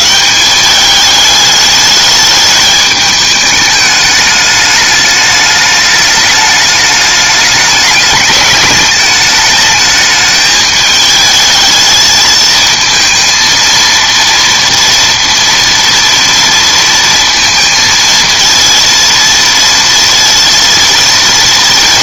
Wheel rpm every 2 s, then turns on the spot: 210, 210, 210, 210, 210, 220, 220, 230, 230, 230, 230.
none